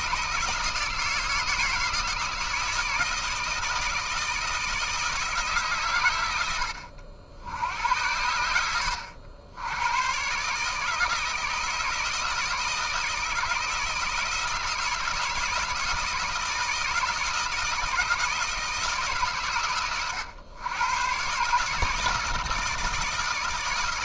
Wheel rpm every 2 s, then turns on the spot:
160, 160, 160, 70, 80, 160, 160, 160, 160, 160, 120, 160.
none